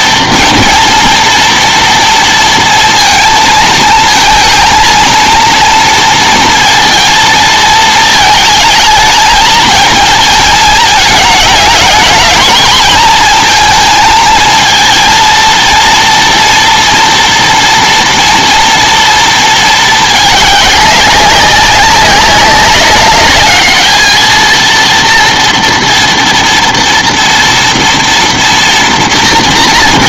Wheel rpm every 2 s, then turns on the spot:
230, 230, 230, 230, 220, 220, 220, 230, 230, 230, 200, 200, 230, 230, 230.
none